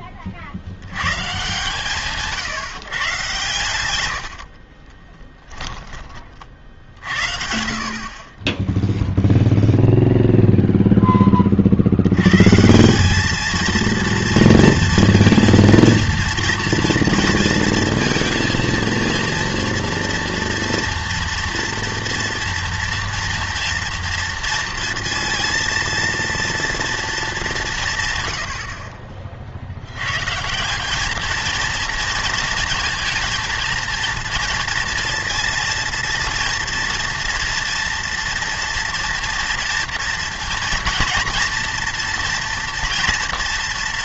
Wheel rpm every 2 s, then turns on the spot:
70, 140, 50, 50, 10, 0, 160, 230, 230, 230, 230, 230, 230, 230, 70, 170, 220, 230, 230, 230, 230, 230.
4-6